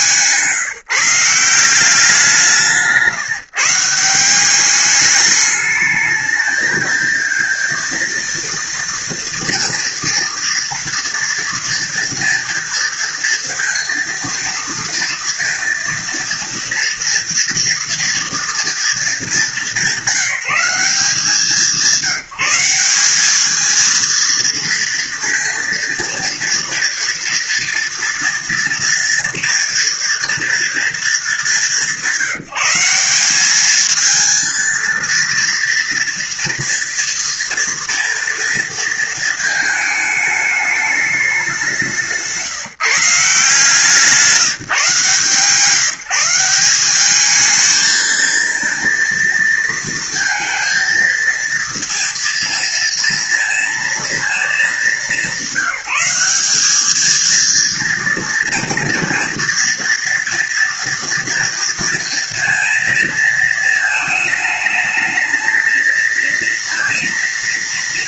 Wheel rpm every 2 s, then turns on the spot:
170, 160, 210, 230, 230, 230, 230, 230, 230, 210, 180, 200, 230, 230, 230, 210, 200, 230, 230, 220, 200, 160, 150, 210, 230, 230, 230, 190, 220, 230, 230, 220, 220, 220.
none